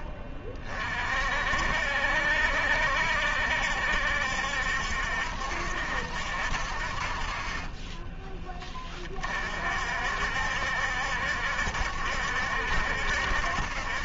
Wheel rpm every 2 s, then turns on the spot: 50, 70, 70, 40, 50, 70, 70.
none